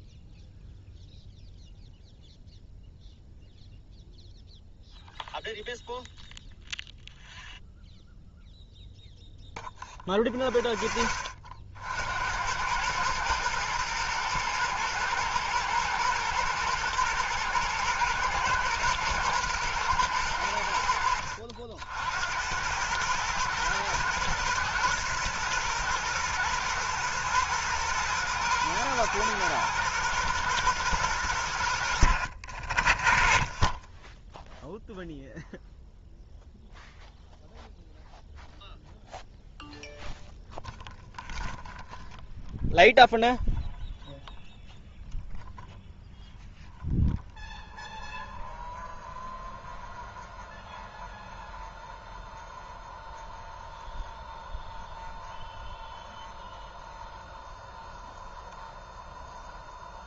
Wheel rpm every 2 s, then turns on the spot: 0, 0, 0, 0, 0, 10, 100, 110, 120, 120, 80, 100, 120, 110, 110, 110, 40, 0, 0, 0, 0, 0, 0, 0, 0, 0, 0, 0, 0, 0.
none